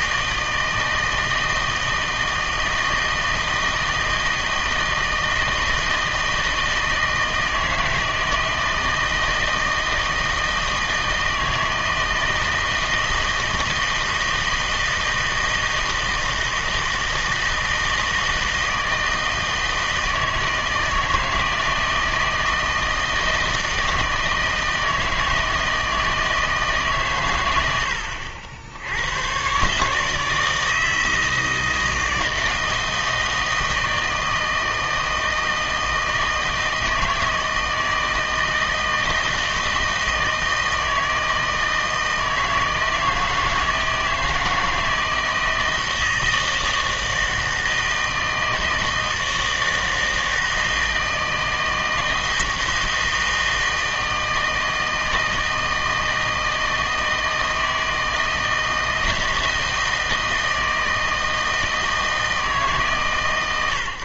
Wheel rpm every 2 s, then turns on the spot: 160, 160, 160, 160, 160, 160, 160, 160, 160, 160, 160, 160, 160, 140, 100, 160, 160, 160, 160, 160, 160, 160, 160, 160, 160, 160, 160, 160, 160, 160, 160, 150.
none